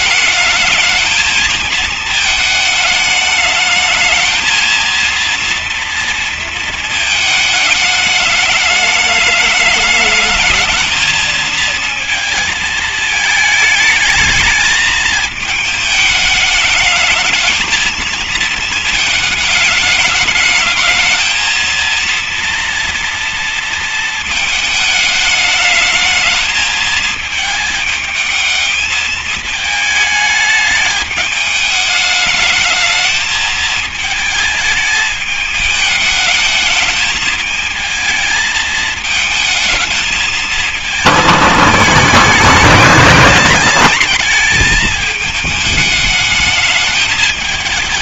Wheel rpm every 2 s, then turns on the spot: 220, 220, 220, 220, 210, 220, 220, 220, 210, 220, 220, 230, 220, 220, 220, 220, 210, 220, 210, 220, 220, 210, 220, 210.
none